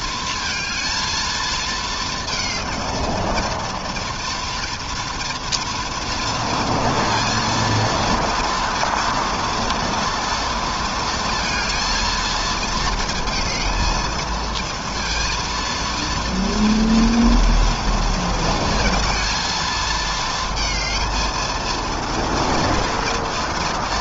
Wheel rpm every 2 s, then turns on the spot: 220, 230, 230, 230, 230, 230, 230, 230, 230, 220, 230, 230.
none